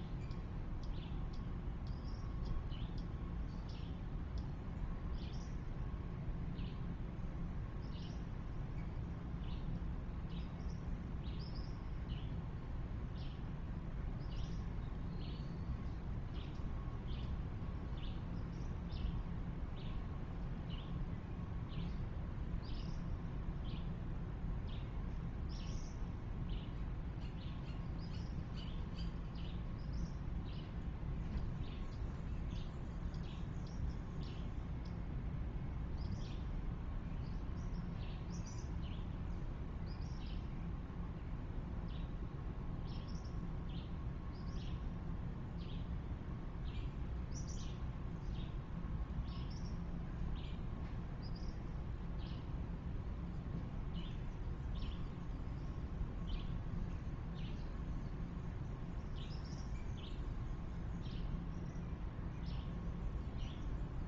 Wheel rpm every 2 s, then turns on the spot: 0, 0, 0, 0, 0, 0, 0, 0, 0, 0, 0, 0, 0, 0, 0, 0, 0, 0, 0, 0, 0, 0, 0, 0, 0, 0, 0, 0, 0, 0, 0, 0.
none